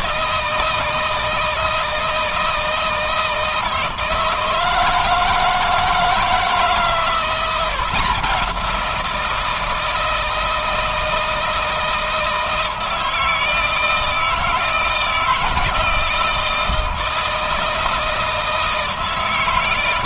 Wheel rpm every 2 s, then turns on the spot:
160, 160, 160, 170, 170, 160, 160, 160, 160, 160.
none